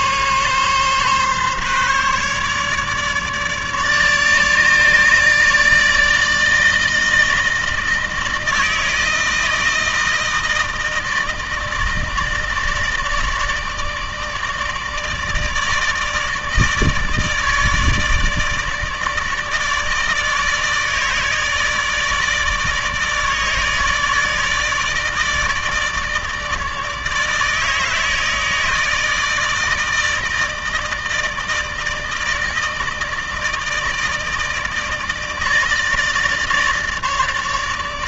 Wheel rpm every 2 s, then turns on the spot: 140, 150, 150, 160, 160, 160, 160, 150, 150, 160, 150, 150, 150, 150, 160, 160, 160, 160, 150.
none